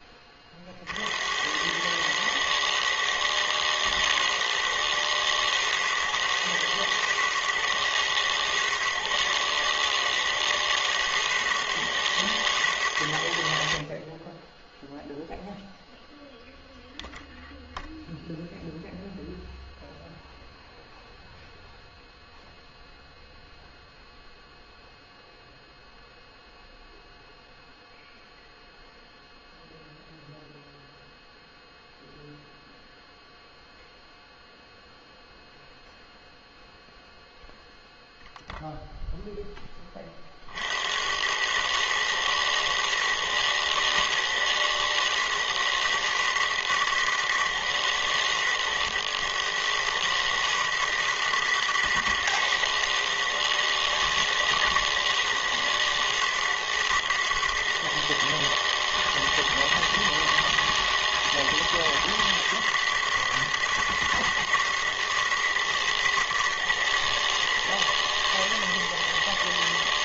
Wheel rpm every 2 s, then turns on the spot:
40, 110, 120, 110, 110, 110, 110, 20, 0, 0, 0, 0, 0, 0, 0, 0, 0, 0, 0, 10, 100, 110, 120, 110, 100, 110, 110, 120, 110, 120, 120, 110, 120, 110, 120.
none